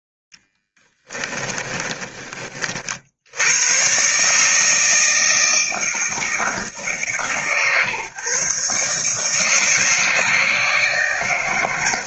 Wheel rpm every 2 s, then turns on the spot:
10, 50, 160, 150, 140, 150.
0-2